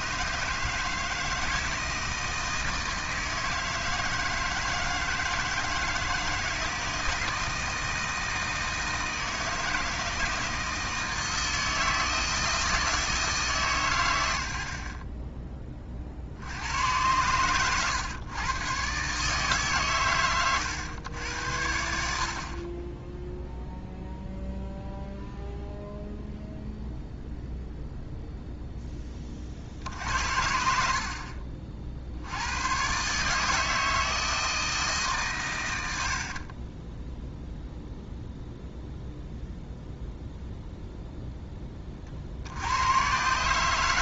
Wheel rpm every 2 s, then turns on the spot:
160, 160, 160, 160, 160, 160, 160, 30, 110, 140, 100, 20, 0, 0, 10, 60, 130, 150, 10, 0, 0, 100.
36-38